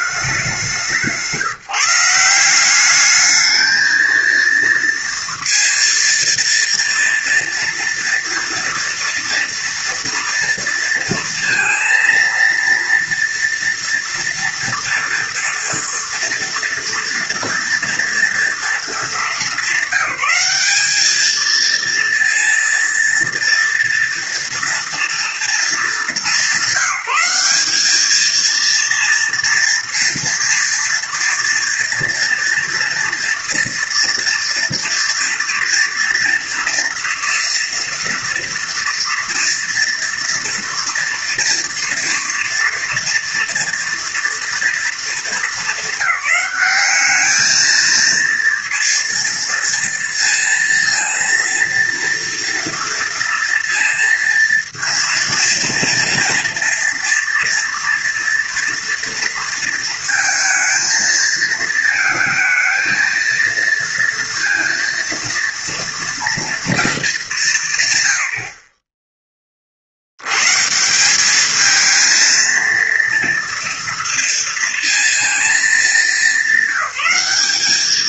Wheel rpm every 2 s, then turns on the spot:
190, 190, 230, 230, 230, 230, 230, 230, 230, 220, 200, 230, 230, 190, 230, 230, 230, 230, 230, 230, 240, 230, 230, 200, 230, 230, 230, 230, 230, 230, 230, 220, 230, 230, 50, 140, 230, 230, 200.
none